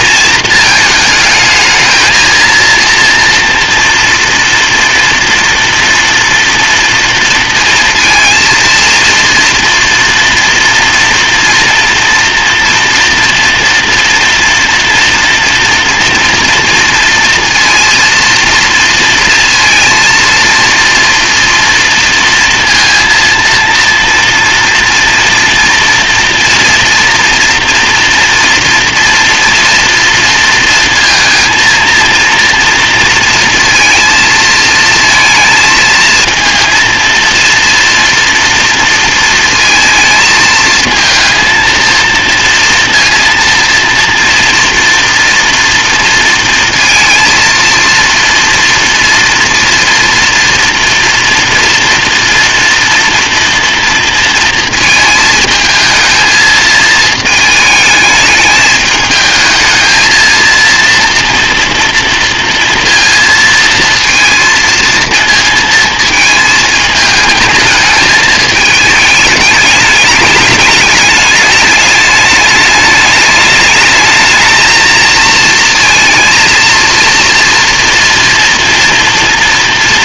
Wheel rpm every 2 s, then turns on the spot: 220, 230, 230, 240, 230, 230, 240, 230, 230, 230, 230, 230, 230, 230, 230, 230, 230, 220, 230, 240, 220, 230, 230, 230, 230, 230, 230, 230, 220, 210, 230, 230, 230, 220, 220, 210, 210, 220, 230, 230.
none